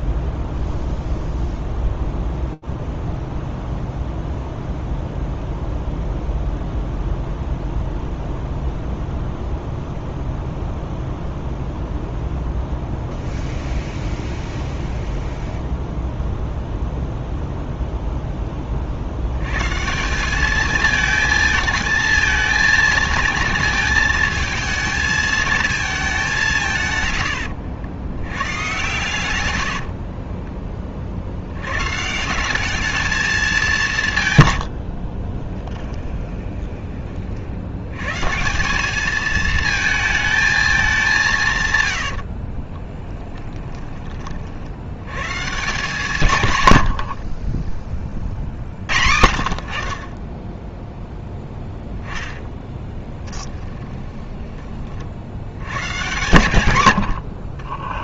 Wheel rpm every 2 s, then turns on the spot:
0, 0, 0, 0, 0, 0, 0, 0, 0, 20, 220, 230, 220, 150, 110, 20, 200, 90, 30, 170, 210, 40, 70, 120, 70, 0, 10, 30, 110.
36-38 42-44 46-48 52-54